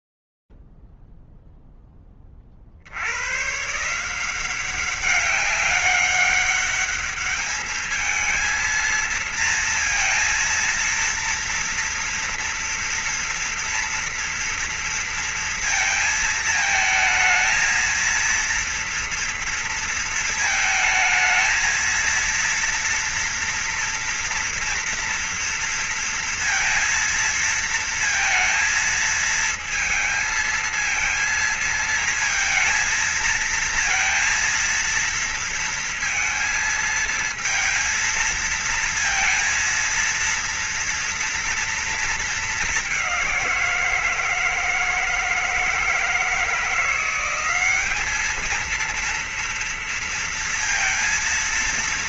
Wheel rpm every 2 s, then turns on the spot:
0, 30, 170, 200, 220, 230, 240, 230, 220, 230, 220, 230, 230, 230, 230, 220, 230, 230, 230, 230, 230, 200, 160, 180, 230, 230.
none